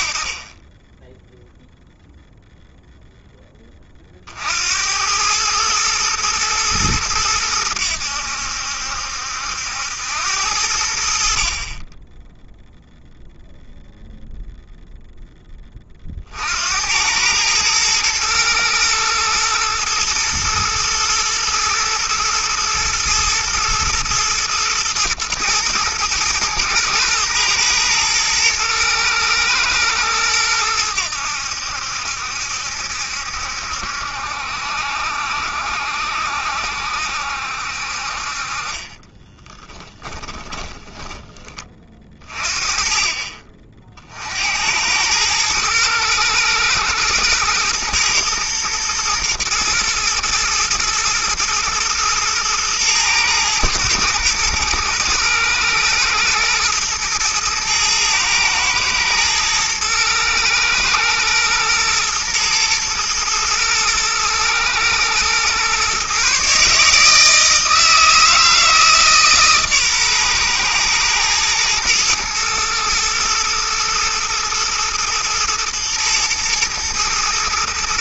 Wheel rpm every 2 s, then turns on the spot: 20, 0, 80, 110, 70, 80, 0, 0, 80, 110, 120, 120, 110, 110, 110, 90, 70, 70, 70, 30, 20, 40, 80, 110, 110, 110, 110, 120, 110, 110, 110, 120, 110, 150, 160, 120, 120, 120, 110.
38-42